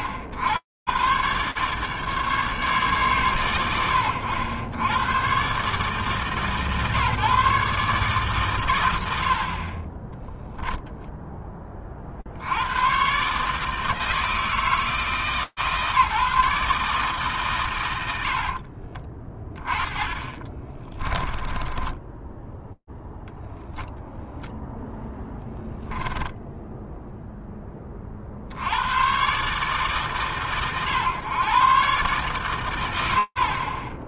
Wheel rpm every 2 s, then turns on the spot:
80, 130, 90, 140, 120, 0, 80, 160, 150, 30, 20, 0, 0, 10, 50, 130, 120.
18-22 26-28